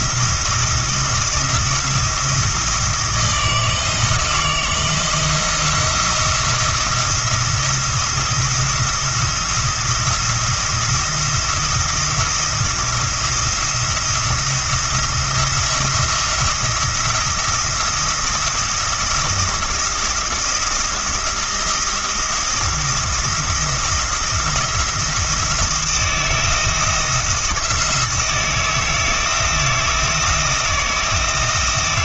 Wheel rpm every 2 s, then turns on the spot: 170, 170, 170, 170, 170, 170, 170, 170, 170, 170, 170, 170, 170, 170, 160, 170.
none